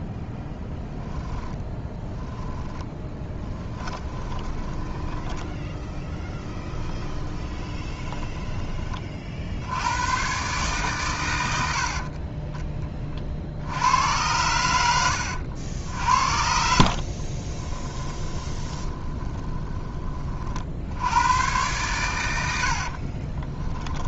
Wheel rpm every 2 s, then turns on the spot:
10, 10, 20, 10, 20, 130, 20, 90, 50, 20, 60, 70.
2-8 16-20 22-24